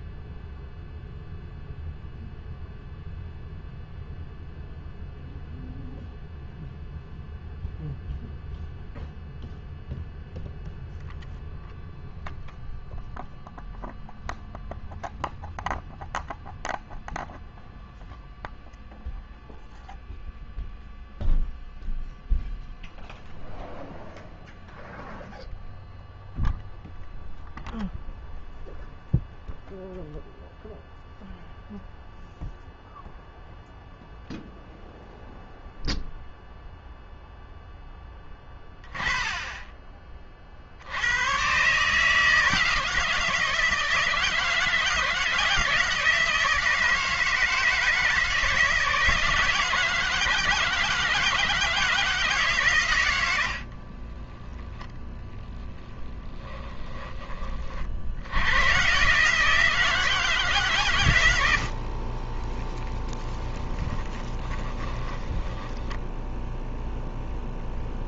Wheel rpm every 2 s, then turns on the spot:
0, 0, 0, 0, 0, 0, 0, 0, 0, 0, 0, 0, 0, 0, 0, 0, 0, 0, 0, 20, 90, 160, 160, 160, 160, 160, 100, 0, 20, 130, 130, 20, 20, 0.
62-66